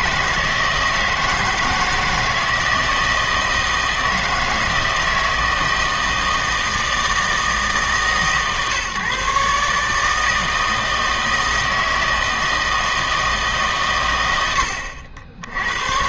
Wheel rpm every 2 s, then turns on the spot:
160, 160, 160, 160, 130, 160, 160, 80.
none